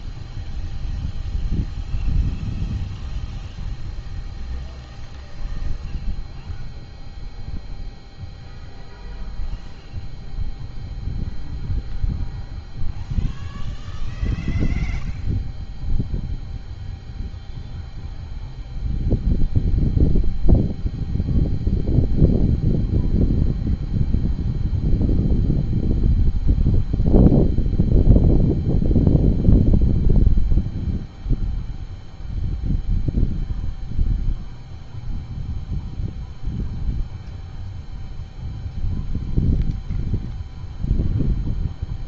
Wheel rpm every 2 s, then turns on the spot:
0, 0, 0, 0, 0, 0, 0, 0, 0, 0, 0, 0, 0, 0, 0, 0, 0, 0, 0, 0, 0.
none